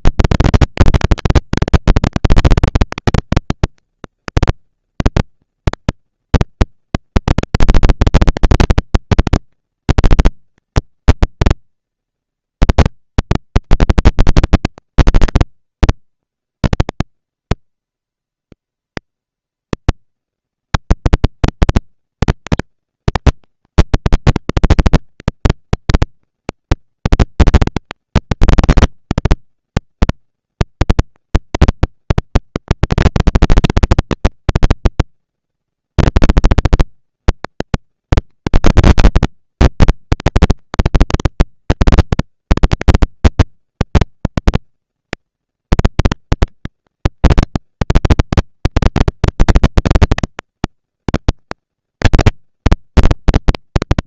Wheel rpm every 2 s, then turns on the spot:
240, 230, 230, 230, 230, 230, 230, 230, 230, 230, 230, 230, 230, 230, 230, 230, 230, 230, 230, 210, 190, 200, 220, 230, 230, 230, 230.
none